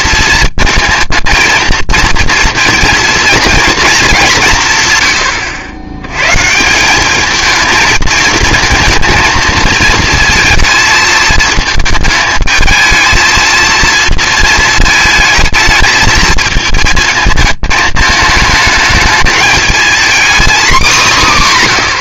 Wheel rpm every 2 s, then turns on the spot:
220, 230, 140, 170, 230, 220, 220, 220, 220, 210, 230.
none